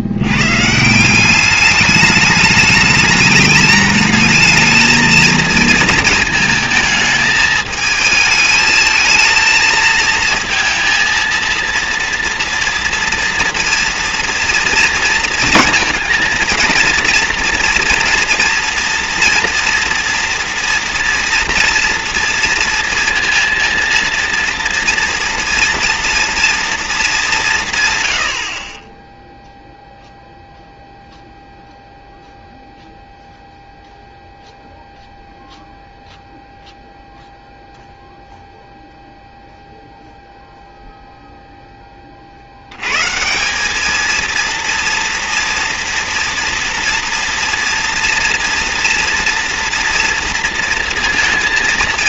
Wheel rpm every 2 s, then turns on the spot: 150, 210, 220, 220, 220, 230, 230, 240, 230, 230, 230, 230, 230, 230, 50, 0, 0, 0, 0, 0, 0, 100, 230, 240, 240, 230.
none